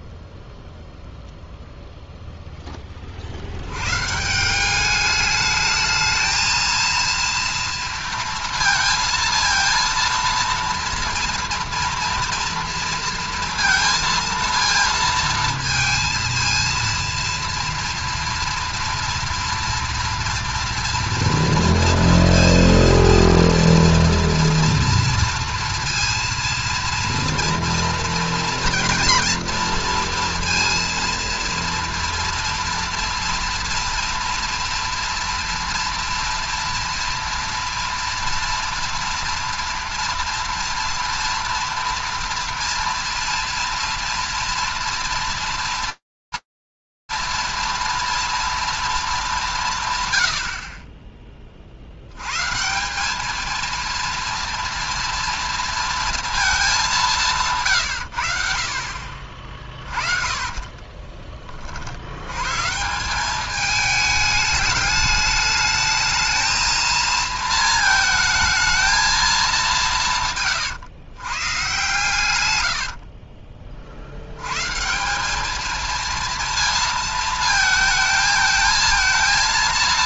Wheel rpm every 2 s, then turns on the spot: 0, 10, 190, 230, 230, 230, 230, 230, 230, 230, 230, 230, 230, 230, 240, 230, 230, 230, 230, 230, 230, 230, 230, 230, 150, 50, 230, 230, 140, 30, 20, 200, 210, 220, 200, 120, 50, 200, 220, 220.
58-60 72-74